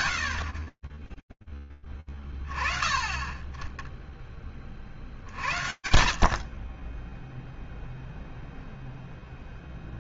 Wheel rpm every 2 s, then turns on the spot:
40, 20, 40, 40, 0.
none